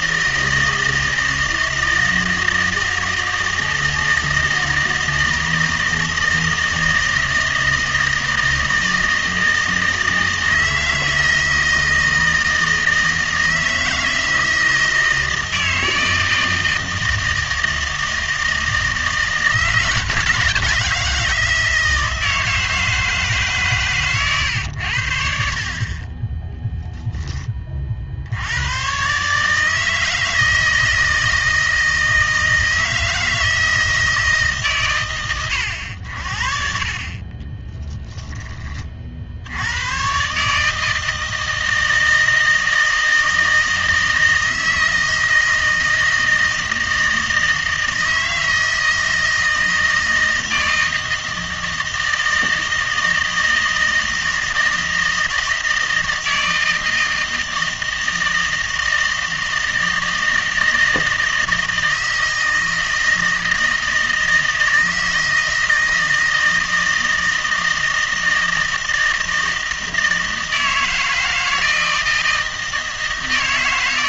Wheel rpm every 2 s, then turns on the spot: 160, 160, 160, 160, 160, 160, 160, 160, 160, 160, 160, 160, 110, 0, 110, 160, 160, 120, 50, 20, 150, 160, 160, 160, 160, 160, 160, 160, 160, 160, 160, 160, 160, 160, 160, 160, 160.
none